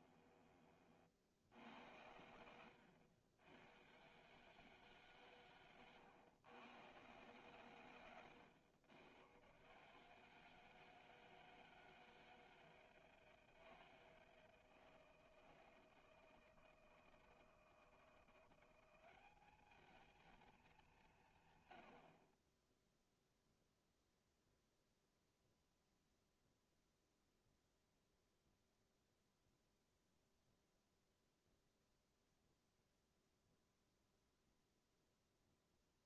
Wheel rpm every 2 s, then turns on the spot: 30, 80, 150, 110, 110, 160, 160, 160, 160, 180, 210, 10, 0, 0, 0, 0, 0, 0.
none